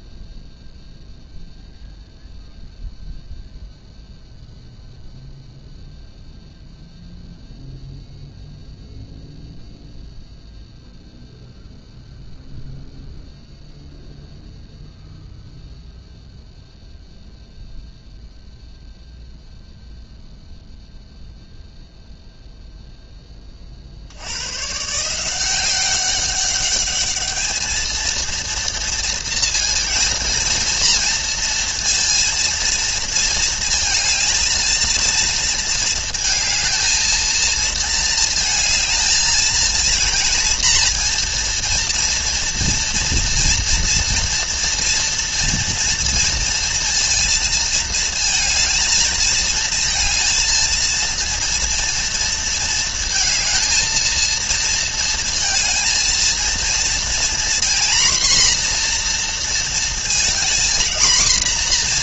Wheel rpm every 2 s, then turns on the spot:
0, 0, 0, 0, 0, 0, 0, 0, 0, 0, 0, 30, 180, 210, 230, 230, 220, 230, 220, 230, 240, 230, 230, 230, 220, 230, 230, 220, 240, 230, 240.
none